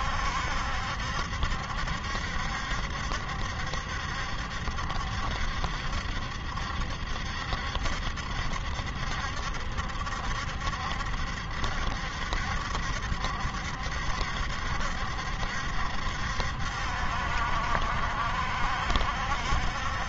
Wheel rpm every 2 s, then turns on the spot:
70, 70, 70, 70, 70, 70, 70, 70, 70, 70.
none